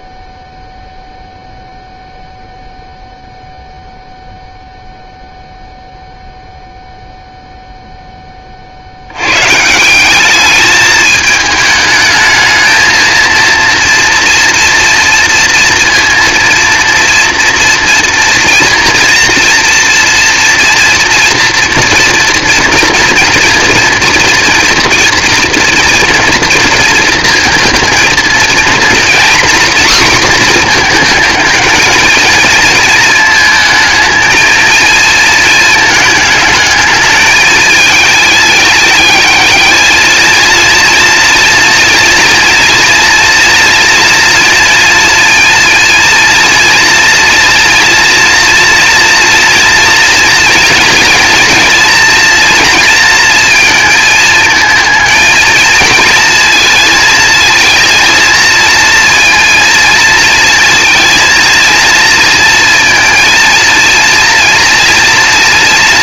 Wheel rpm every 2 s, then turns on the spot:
0, 0, 0, 0, 70, 210, 220, 230, 230, 240, 230, 230, 230, 230, 230, 240, 230, 230, 210, 210, 230, 230, 230, 230, 240, 230, 230, 230, 220, 230, 230, 230, 230.
none